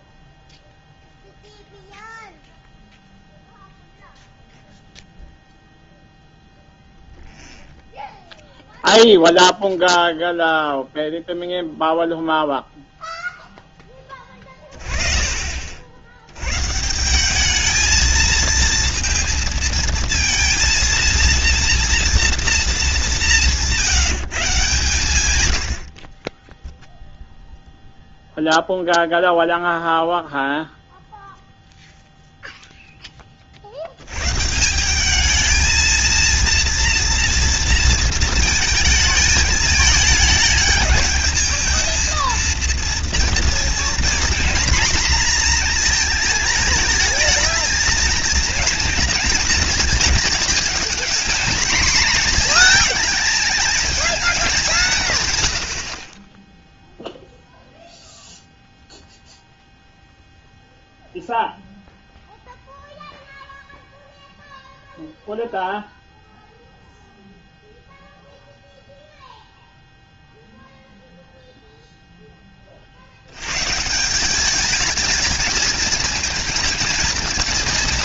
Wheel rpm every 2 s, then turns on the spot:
0, 0, 0, 0, 0, 0, 0, 20, 130, 230, 230, 220, 140, 10, 0, 0, 0, 160, 230, 220, 210, 230, 240, 220, 230, 220, 220, 190, 0, 0, 0, 0, 0, 0, 0, 0, 30, 210, 230.
none